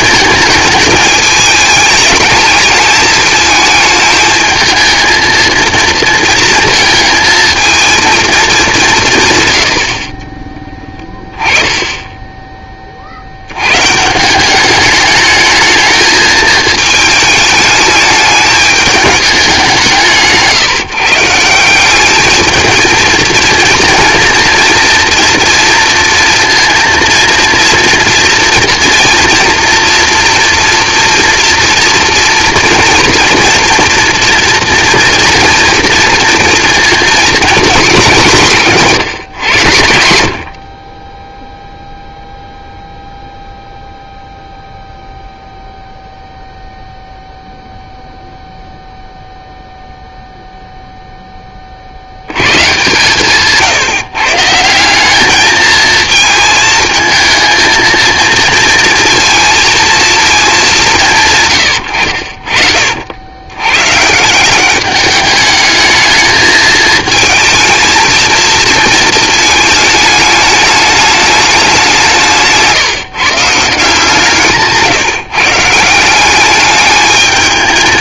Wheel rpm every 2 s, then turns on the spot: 220, 220, 220, 230, 210, 20, 20, 190, 220, 210, 160, 220, 230, 230, 230, 230, 240, 230, 230, 150, 40, 0, 0, 0, 0, 0, 120, 160, 220, 230, 200, 50, 190, 220, 230, 210, 160, 150, 200.
74-76